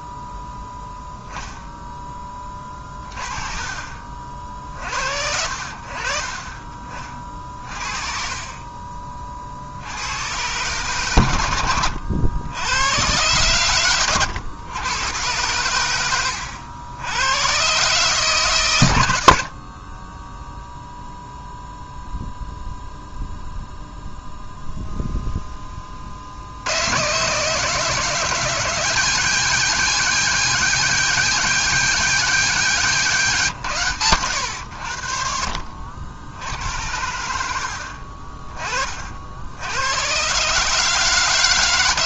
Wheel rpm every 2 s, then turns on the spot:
0, 30, 60, 30, 30, 130, 100, 110, 90, 110, 0, 0, 0, 110, 170, 170, 160, 70, 90, 40, 150.
none